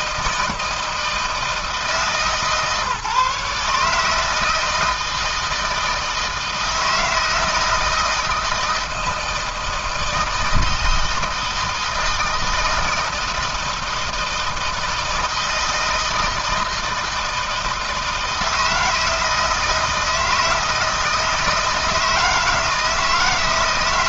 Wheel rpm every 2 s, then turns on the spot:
160, 150, 160, 160, 160, 160, 160, 160, 160, 160, 160, 170.
none